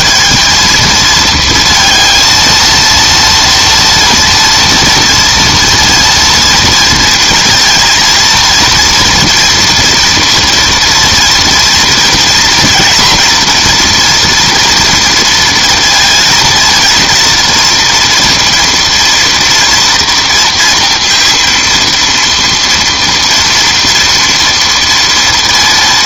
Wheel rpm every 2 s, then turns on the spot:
230, 230, 230, 230, 230, 230, 230, 230, 230, 230, 230, 230, 230.
none